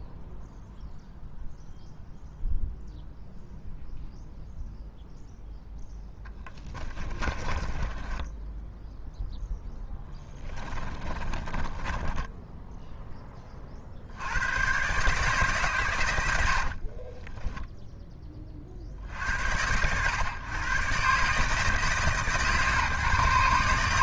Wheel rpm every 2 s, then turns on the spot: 0, 0, 0, 10, 0, 20, 0, 130, 50, 40, 120, 140.
6-8 10-12 16-18